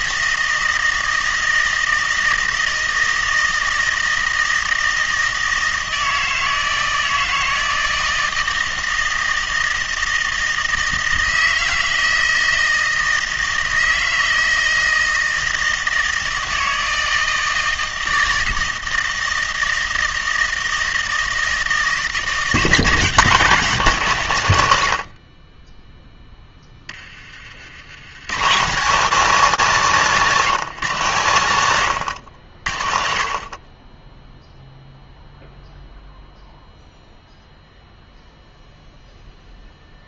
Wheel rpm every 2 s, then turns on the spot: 160, 160, 160, 160, 160, 160, 160, 160, 160, 160, 160, 150, 100, 20, 150, 170, 60, 0, 0, 0.
none